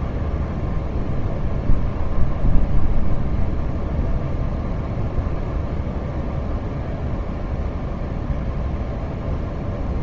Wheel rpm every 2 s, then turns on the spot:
0, 0, 0, 0, 0.
none